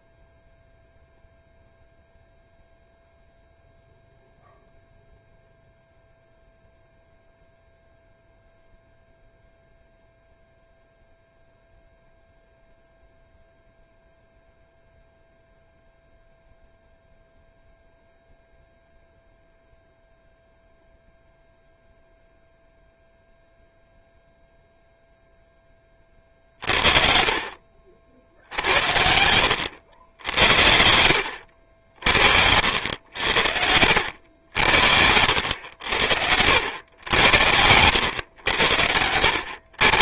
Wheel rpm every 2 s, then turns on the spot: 0, 0, 0, 0, 0, 0, 0, 0, 0, 0, 0, 0, 0, 50, 80, 70, 70, 70, 90, 90.
30-32